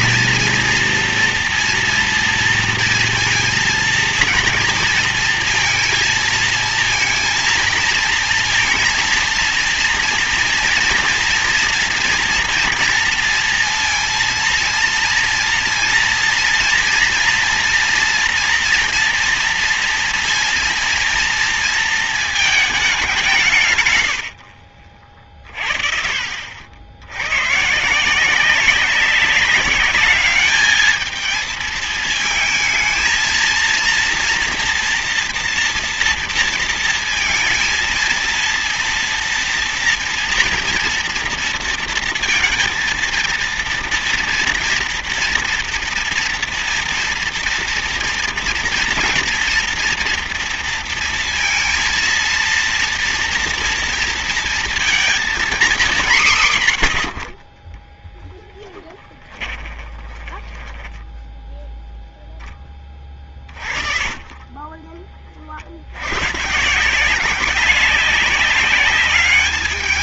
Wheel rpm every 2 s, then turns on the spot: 230, 230, 230, 230, 230, 240, 240, 230, 230, 230, 230, 210, 50, 70, 200, 220, 220, 230, 230, 230, 230, 230, 230, 240, 230, 230, 230, 230, 110, 20, 10, 20, 30, 160, 200.
58-62